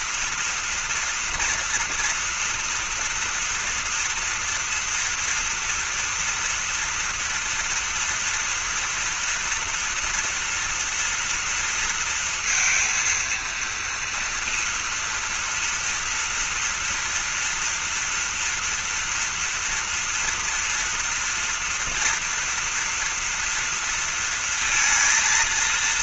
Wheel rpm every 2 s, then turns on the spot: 230, 240, 240, 230, 230, 230, 230, 230, 230, 230, 240, 240, 230.
none